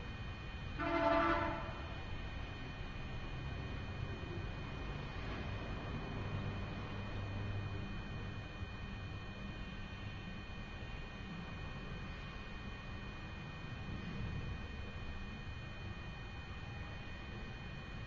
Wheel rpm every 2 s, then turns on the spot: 0, 0, 0, 0, 0, 0, 0, 0, 0.
none